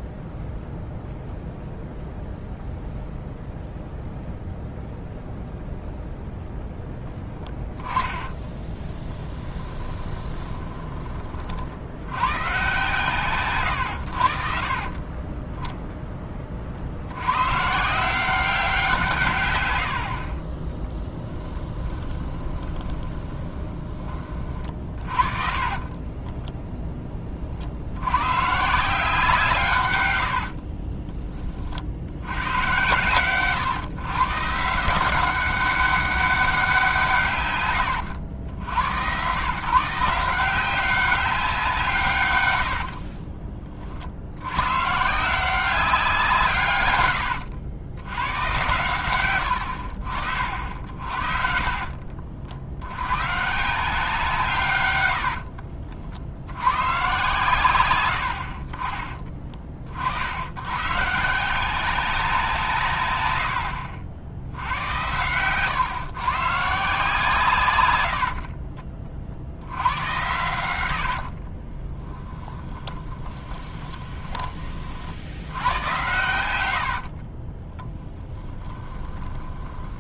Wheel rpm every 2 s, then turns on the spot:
0, 0, 0, 10, 20, 20, 130, 40, 60, 180, 20, 20, 40, 10, 150, 30, 110, 160, 180, 90, 180, 80, 140, 120, 110, 60, 80, 130, 100, 30, 120, 150, 80, 150, 40, 90, 20, 40, 80, 20.
8-12 20-26 30-32 42-44 50-52 70-74 76-80